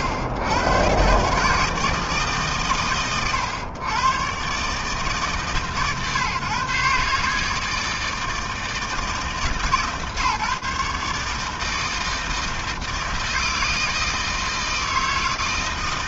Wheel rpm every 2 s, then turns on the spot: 110, 130, 130, 140, 160, 150, 160, 160.
none